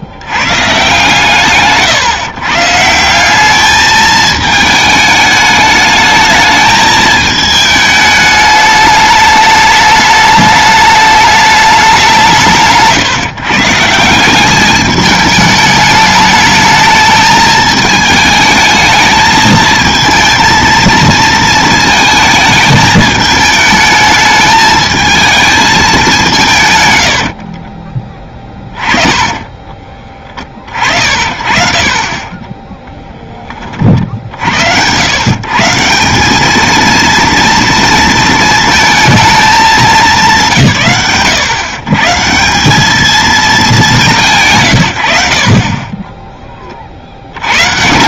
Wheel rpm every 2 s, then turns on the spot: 140, 160, 210, 220, 210, 210, 150, 210, 220, 220, 230, 220, 220, 120, 20, 40, 20, 100, 220, 220, 150, 190, 110, 40.
28-30 32-34